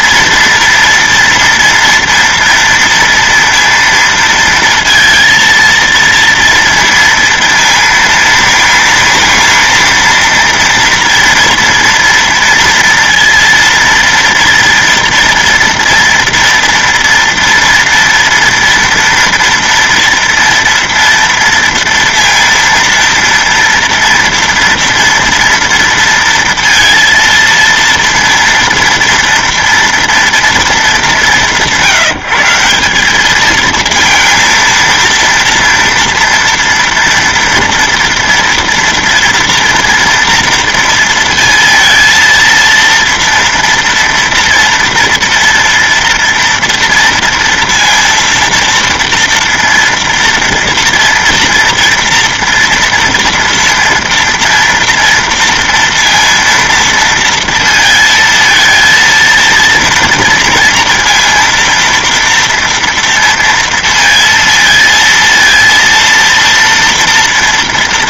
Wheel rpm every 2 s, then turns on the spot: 230, 230, 230, 230, 230, 230, 230, 230, 230, 230, 230, 230, 230, 230, 230, 230, 170, 230, 230, 230, 230, 230, 230, 230, 230, 230, 240, 240, 230, 230, 230, 230, 230, 230.
none